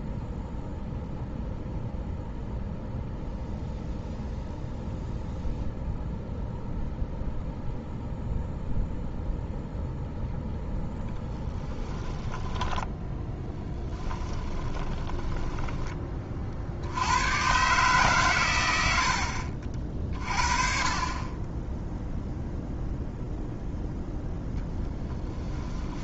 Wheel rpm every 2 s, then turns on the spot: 0, 0, 0, 0, 0, 0, 10, 20, 60, 100, 30, 0, 10.
12-16 24-26